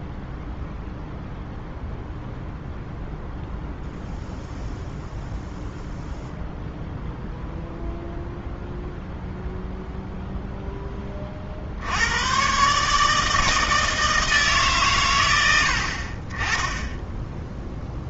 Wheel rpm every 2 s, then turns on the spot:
0, 0, 0, 0, 0, 10, 140, 150, 20.
none